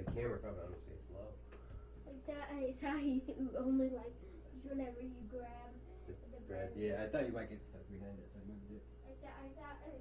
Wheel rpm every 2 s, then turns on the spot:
0, 0, 0, 0, 0.
none